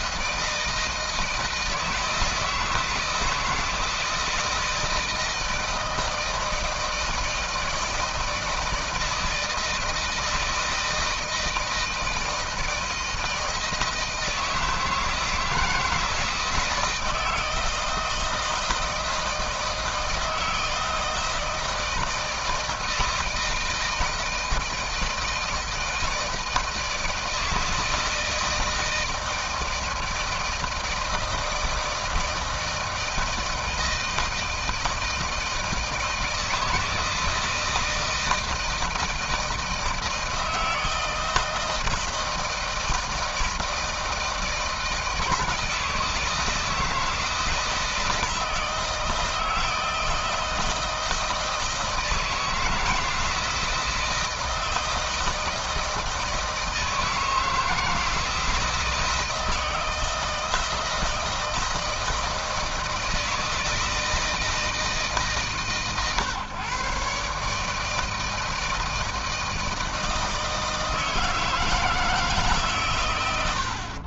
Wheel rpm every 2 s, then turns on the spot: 170, 160, 160, 160, 160, 160, 160, 160, 160, 160, 160, 170, 160, 160, 160, 160, 160, 160, 160, 160, 160, 160, 160, 160, 160, 160, 170, 160, 160, 160, 160, 160, 160, 130, 160, 160, 140.
none